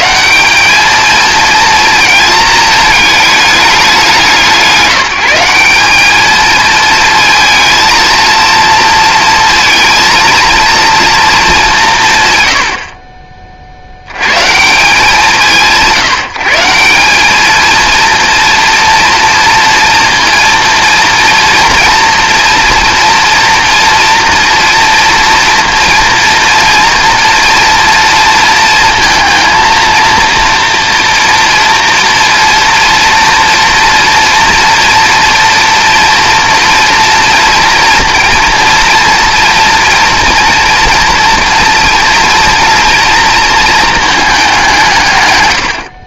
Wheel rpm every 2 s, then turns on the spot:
200, 220, 180, 220, 230, 230, 70, 160, 170, 230, 230, 230, 230, 240, 230, 230, 230, 240, 230, 230, 230, 230, 160.
none